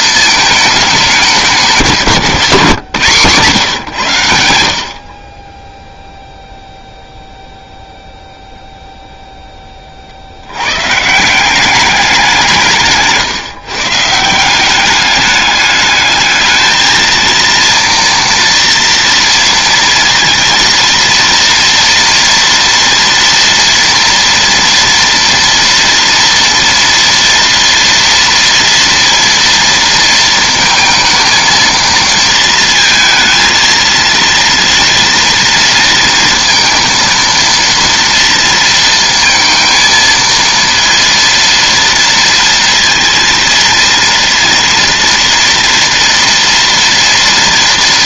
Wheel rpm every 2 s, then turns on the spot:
200, 150, 60, 0, 0, 130, 160, 190, 220, 230, 230, 230, 230, 230, 230, 220, 230, 230, 230, 230, 230, 230, 230, 230.
none